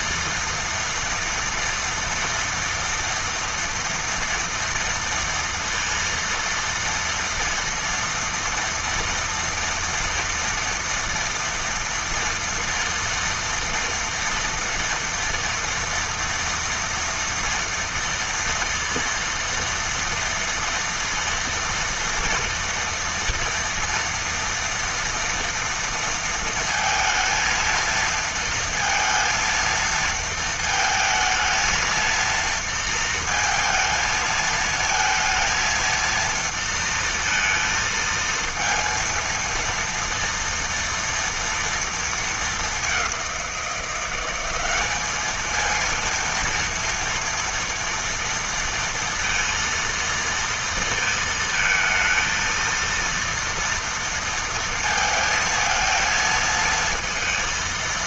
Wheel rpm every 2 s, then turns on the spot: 230, 230, 230, 230, 230, 230, 230, 230, 230, 230, 230, 230, 230, 230, 230, 220, 230, 230, 230, 230, 230, 210, 200, 230, 230, 230, 230, 230, 230.
none